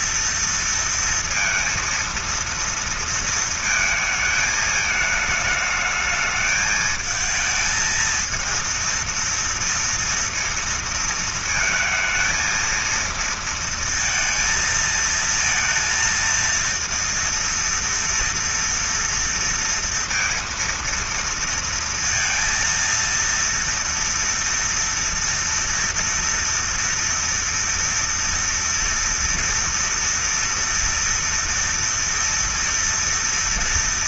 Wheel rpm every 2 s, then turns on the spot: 230, 230, 220, 220, 230, 230, 230, 220, 230, 230, 230, 230, 230, 230, 230, 230, 230.
none